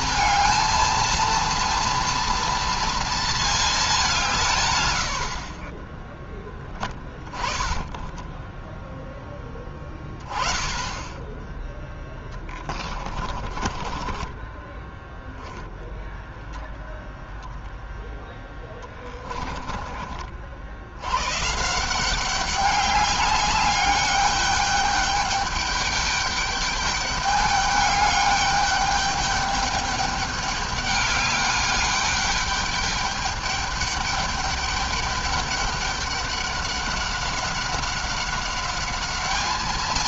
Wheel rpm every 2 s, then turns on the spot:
230, 230, 120, 20, 10, 20, 20, 10, 0, 10, 70, 200, 200, 200, 210, 200, 210, 210, 200, 200.
6-8 12-16 18-20